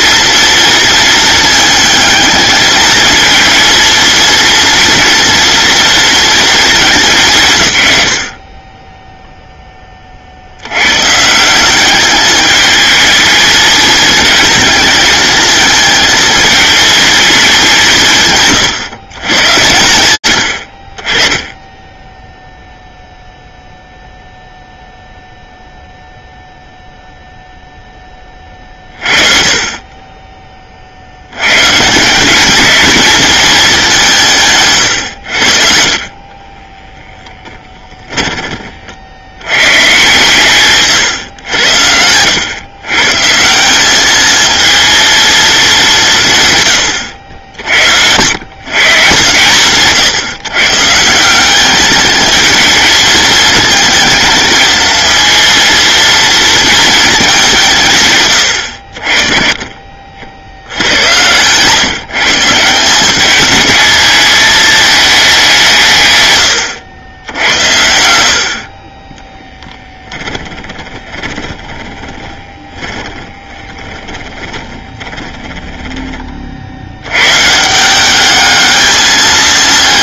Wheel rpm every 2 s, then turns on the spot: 230, 220, 230, 210, 20, 100, 220, 220, 220, 130, 50, 0, 0, 0, 40, 60, 220, 90, 10, 70, 120, 150, 230, 90, 130, 170, 220, 230, 210, 40, 90, 180, 210, 80, 20, 20, 30, 20, 70, 210.
36-38 70-76